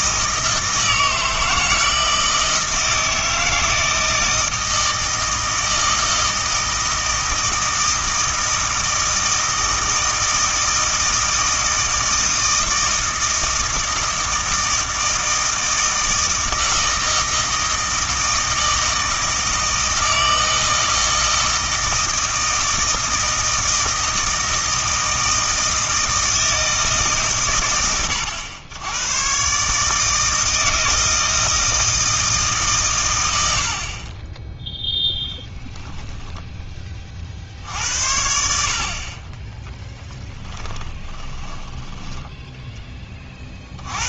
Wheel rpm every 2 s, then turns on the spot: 160, 160, 160, 160, 160, 160, 160, 160, 160, 160, 160, 160, 160, 160, 100, 160, 140, 0, 20, 70, 10, 10.
40-42